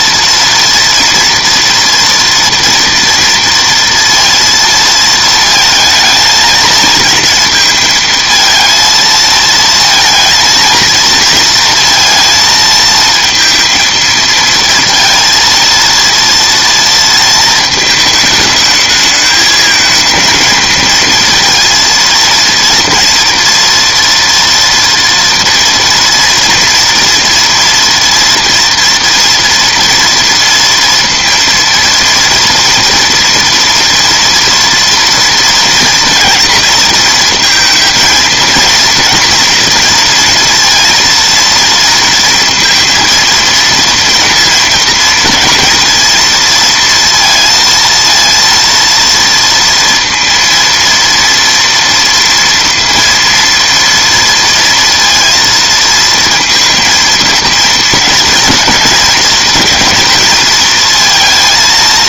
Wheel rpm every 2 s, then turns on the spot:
230, 230, 230, 230, 220, 230, 220, 230, 230, 220, 230, 230, 240, 230, 230, 230, 230, 230, 230, 230, 230, 230, 230, 230, 230, 230, 230, 230, 230, 230, 230.
none